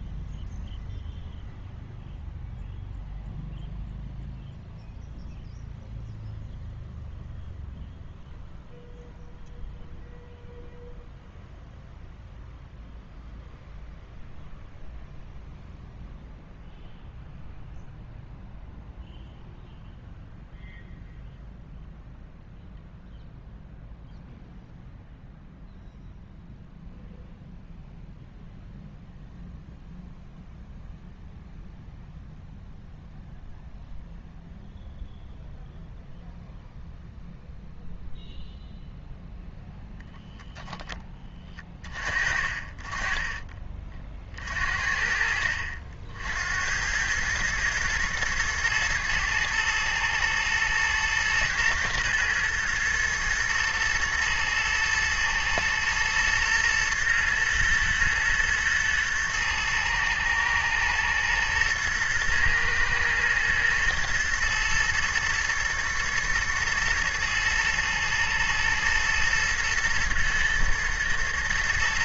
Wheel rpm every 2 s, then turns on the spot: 0, 0, 0, 0, 0, 0, 0, 0, 0, 0, 0, 0, 0, 0, 0, 0, 0, 0, 0, 0, 10, 30, 50, 80, 110, 110, 110, 120, 110, 110, 110, 120, 120, 110, 110, 110.
none